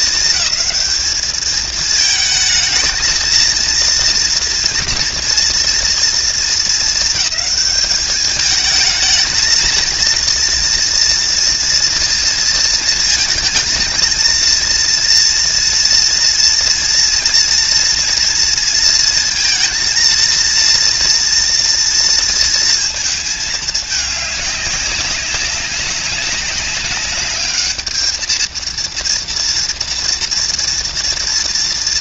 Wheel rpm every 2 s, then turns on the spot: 210, 220, 230, 230, 210, 230, 230, 230, 230, 230, 230, 230, 200, 200, 230, 230.
none